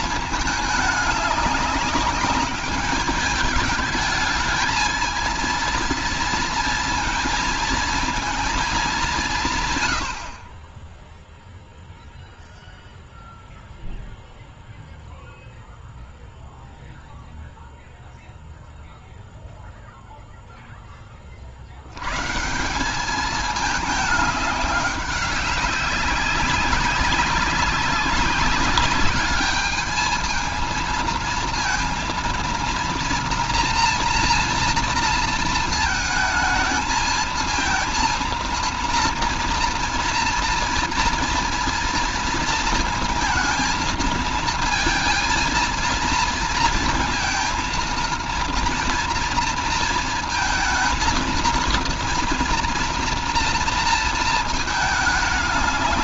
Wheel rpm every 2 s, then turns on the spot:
210, 200, 220, 230, 200, 20, 0, 0, 0, 0, 40, 210, 200, 200, 210, 230, 230, 230, 230, 240, 240, 230, 230, 230, 230, 230, 230, 210.
none